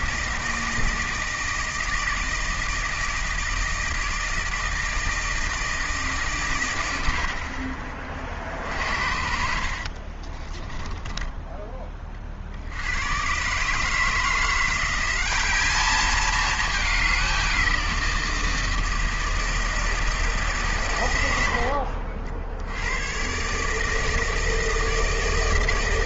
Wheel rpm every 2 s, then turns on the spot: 160, 160, 160, 120, 50, 20, 80, 170, 210, 170, 140, 70, 160.
10-12